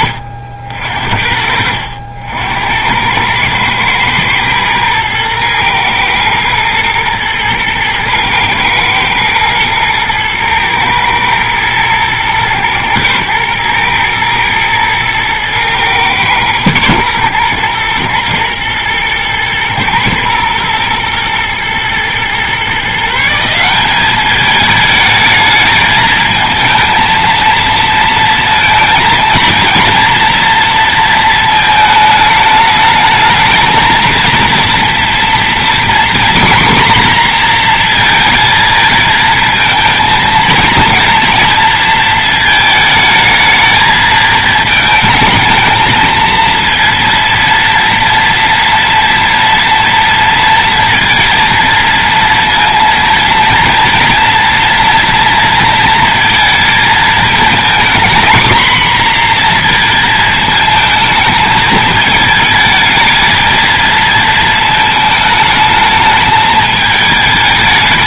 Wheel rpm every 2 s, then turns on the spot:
50, 80, 110, 110, 110, 110, 120, 110, 110, 110, 110, 140, 210, 230, 230, 230, 220, 230, 250, 230, 230, 220, 220, 230, 240, 230, 230, 230, 230, 230, 220, 220, 220, 220.
none